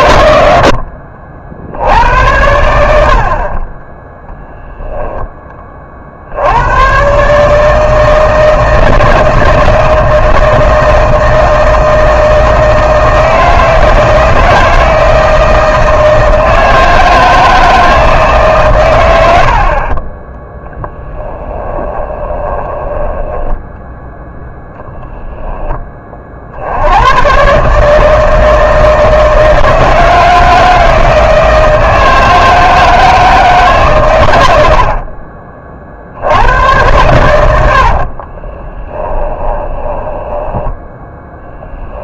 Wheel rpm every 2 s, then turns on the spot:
70, 80, 0, 110, 160, 160, 160, 160, 160, 120, 0, 10, 0, 90, 160, 160, 160, 60, 100, 20, 10.
22-24 38-42